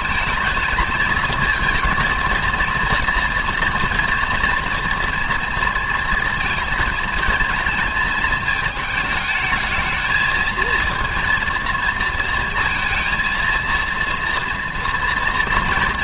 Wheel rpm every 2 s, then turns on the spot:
220, 230, 230, 230, 220, 230, 230, 230.
none